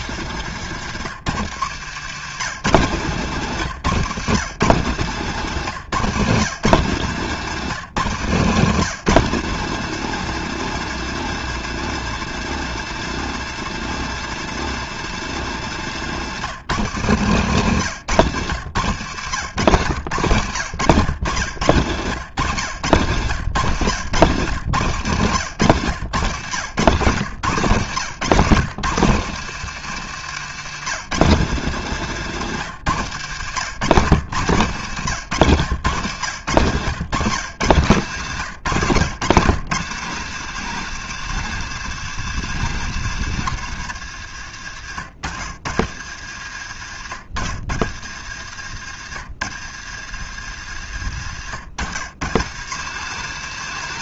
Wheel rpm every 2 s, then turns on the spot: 130, 150, 160, 170, 180, 200, 200, 190, 160, 110, 120, 120, 120, 110, 150, 160, 130, 140, 130, 130, 190, 160, 90, 80, 100, 90, 170.
2-4